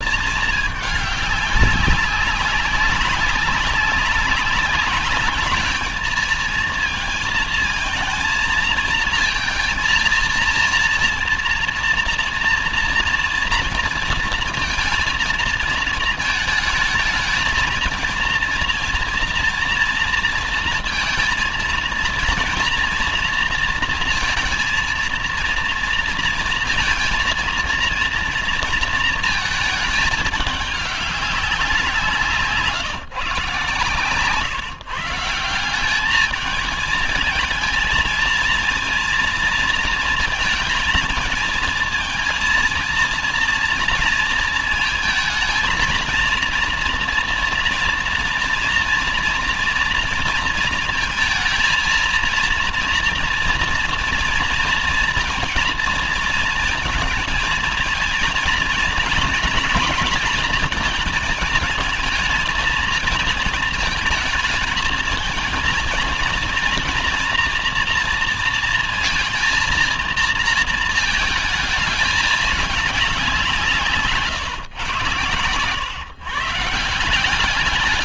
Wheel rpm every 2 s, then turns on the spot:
200, 190, 200, 220, 230, 230, 230, 230, 220, 230, 230, 230, 230, 230, 230, 200, 150, 150, 220, 230, 220, 230, 230, 230, 230, 230, 230, 230, 230, 230, 230, 230, 220, 230, 230, 220, 200, 120, 160.
none